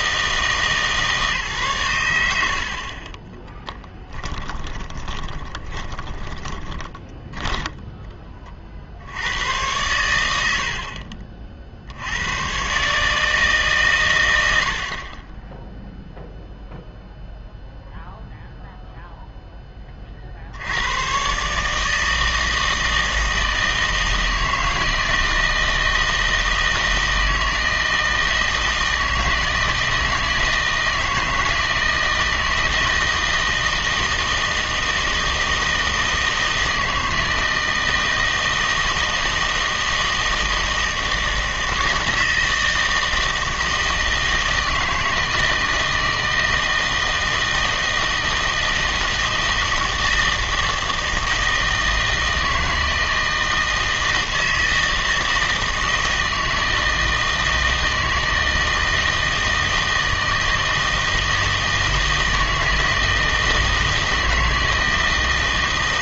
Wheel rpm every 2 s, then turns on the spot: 160, 60, 20, 20, 40, 70, 130, 70, 0, 0, 80, 160, 160, 160, 160, 160, 160, 160, 160, 160, 160, 160, 160, 160, 160, 160, 160, 160, 160, 160, 160, 160, 160.
4-8